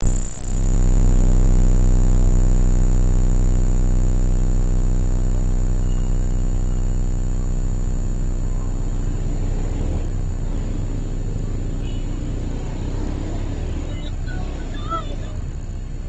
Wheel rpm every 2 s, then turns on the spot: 0, 0, 0, 0, 0, 0, 0, 0.
none